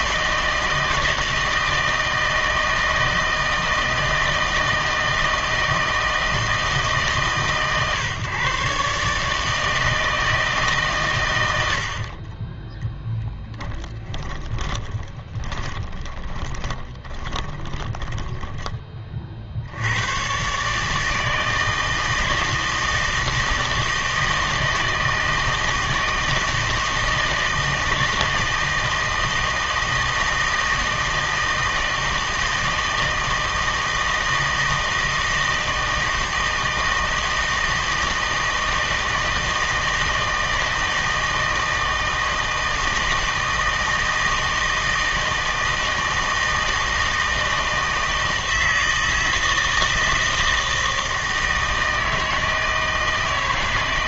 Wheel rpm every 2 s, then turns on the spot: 160, 160, 160, 160, 140, 150, 10, 10, 30, 20, 150, 160, 160, 160, 160, 160, 160, 160, 160, 160, 160, 160, 160, 160, 160, 160, 160.
14-20